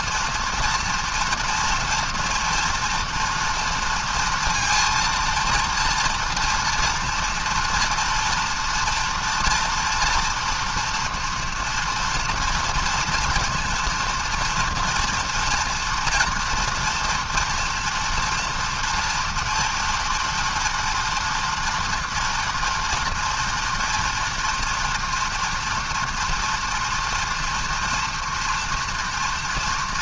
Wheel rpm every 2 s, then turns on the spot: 230, 240, 230, 230, 240, 240, 240, 230, 230, 230, 230, 240, 230, 230, 240.
none